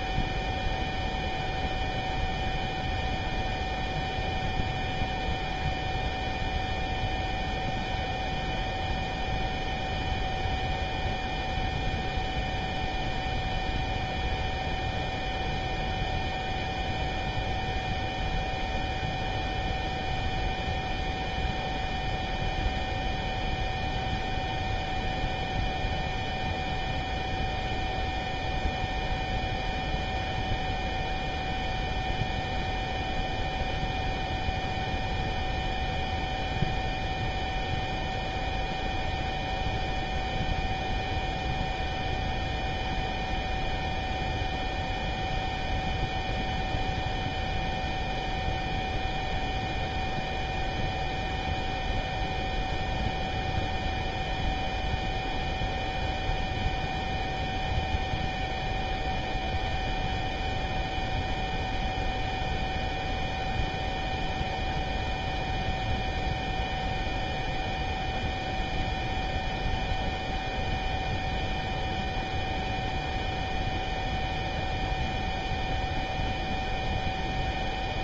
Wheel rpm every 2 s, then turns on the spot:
0, 0, 0, 0, 0, 0, 0, 0, 0, 0, 0, 0, 0, 0, 0, 0, 0, 0, 0, 0, 0, 0, 0, 0, 0, 0, 0, 0, 0, 0, 0, 0, 0, 0, 0, 0, 0, 0, 0.
none